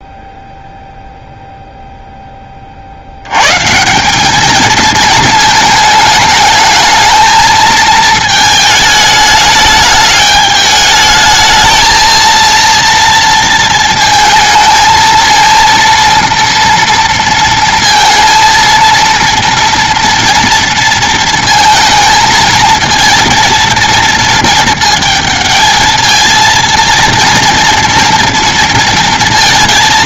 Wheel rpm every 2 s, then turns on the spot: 0, 60, 220, 220, 220, 210, 230, 230, 230, 230, 230, 230, 220, 230, 230.
none